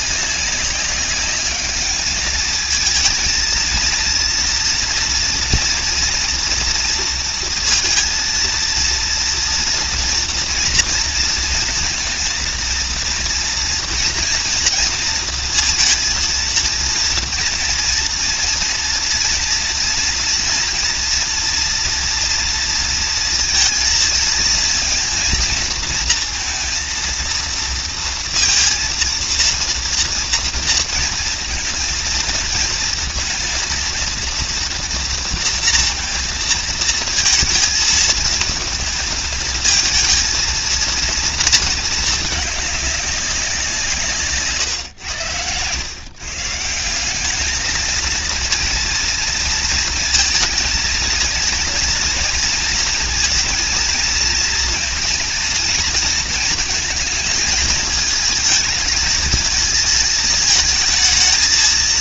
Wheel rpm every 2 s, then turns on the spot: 200, 220, 230, 230, 230, 230, 230, 230, 230, 230, 230, 230, 230, 230, 230, 230, 230, 230, 220, 220, 230, 200, 110, 180, 230, 230, 230, 230, 230, 220, 220.
none